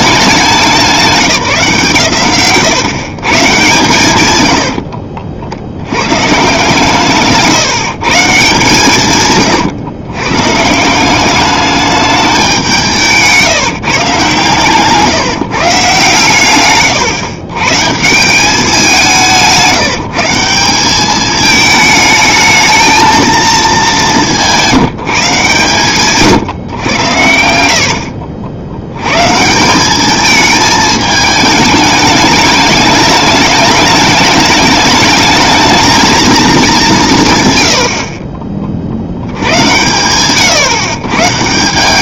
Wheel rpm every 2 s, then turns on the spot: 190, 130, 90, 140, 160, 160, 180, 140, 130, 190, 180, 220, 170, 130, 90, 220, 210, 210, 180, 60, 130.
2-6 14-18